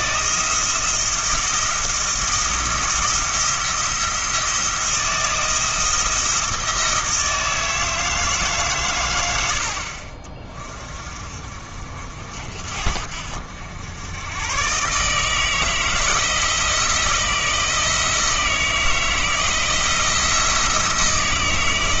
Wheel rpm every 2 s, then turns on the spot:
160, 160, 170, 160, 130, 30, 60, 140, 170, 170, 170.
none